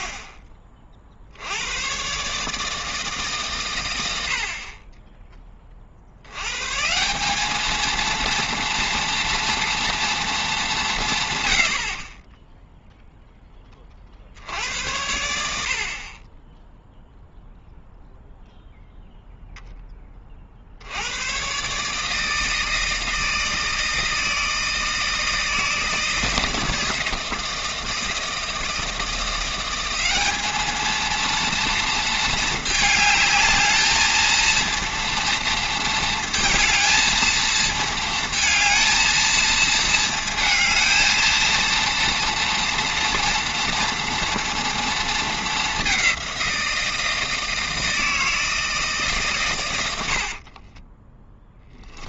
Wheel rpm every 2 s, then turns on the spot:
30, 160, 40, 140, 230, 190, 0, 90, 10, 0, 70, 160, 160, 160, 160, 220, 220, 230, 230, 230, 220, 230, 230, 170, 160, 30.
50-52